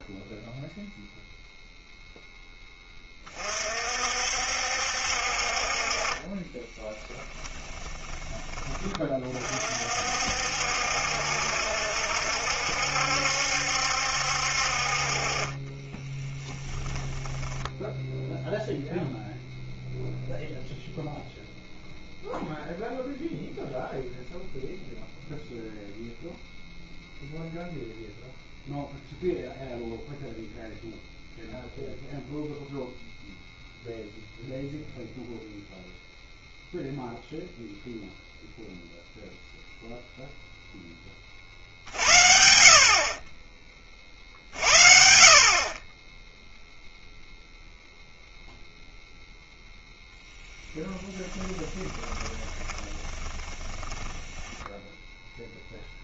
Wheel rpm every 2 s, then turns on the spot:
0, 10, 60, 20, 20, 60, 70, 50, 20, 0, 0, 0, 0, 0, 0, 0, 0, 0, 0, 0, 10, 70, 50, 0, 0, 10, 20, 20.
6-8 16-18 50-56